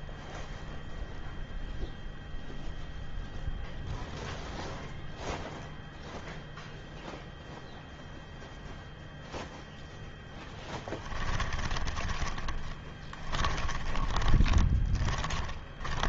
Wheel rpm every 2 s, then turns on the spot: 0, 0, 0, 0, 0, 10, 10, 10.
10-16